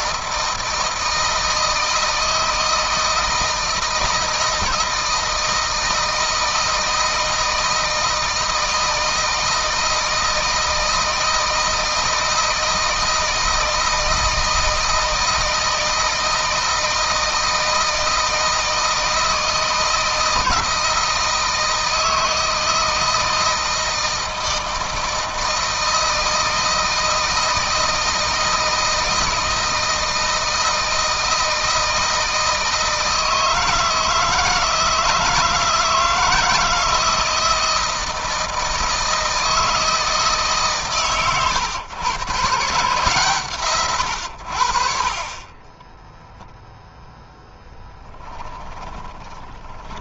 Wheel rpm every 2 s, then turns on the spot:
160, 160, 160, 160, 160, 160, 160, 160, 160, 160, 160, 160, 160, 160, 160, 160, 160, 160, 160, 160, 150, 140, 70, 0, 20.
48-50